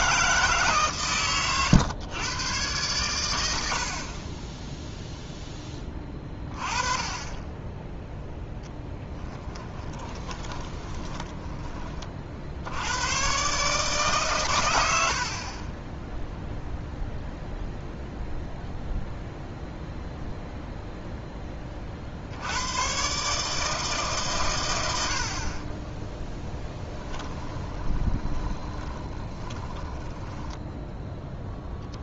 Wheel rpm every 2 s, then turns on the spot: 140, 120, 10, 20, 10, 20, 90, 90, 0, 0, 0, 110, 90, 10, 20, 10.
8-12 26-30